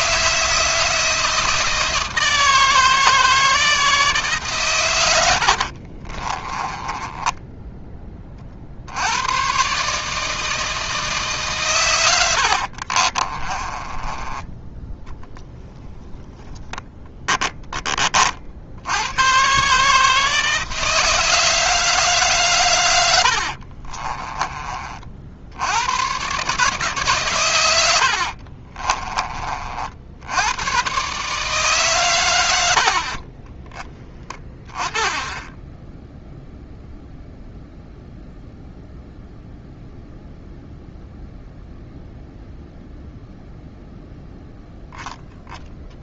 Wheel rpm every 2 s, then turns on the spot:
160, 160, 110, 10, 80, 160, 40, 10, 10, 80, 160, 100, 40, 140, 30, 120, 60, 10, 0, 0, 0, 0, 0.
6-8 12-14 16-18 28-30